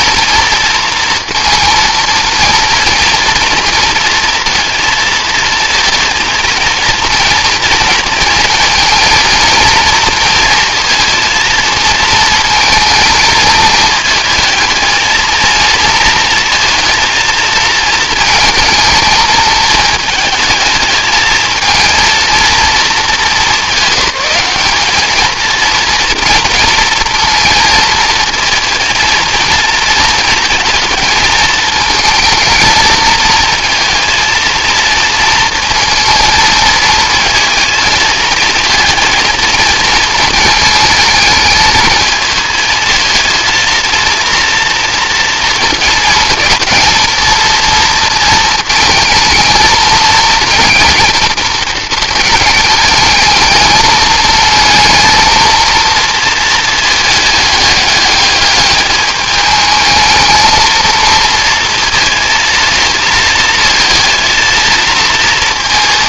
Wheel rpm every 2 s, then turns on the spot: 230, 230, 230, 230, 220, 230, 220, 220, 220, 220, 220, 230, 210, 220, 230, 220, 220, 230, 230, 230, 220, 230, 230, 220, 230, 230, 210, 220, 220, 210, 230, 220, 230.
none